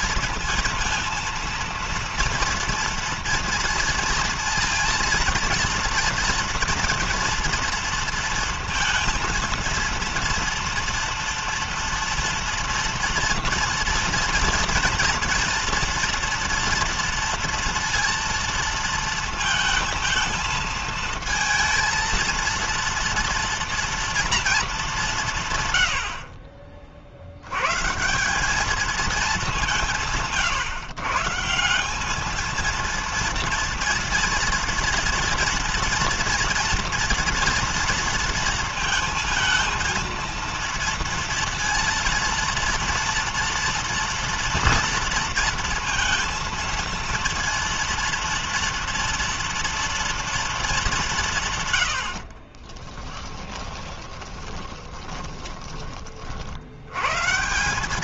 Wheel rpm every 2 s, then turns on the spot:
230, 230, 230, 230, 230, 230, 230, 240, 230, 230, 230, 230, 200, 50, 210, 130, 230, 230, 240, 230, 230, 230, 230, 230, 230, 200, 20, 30, 110.
52-56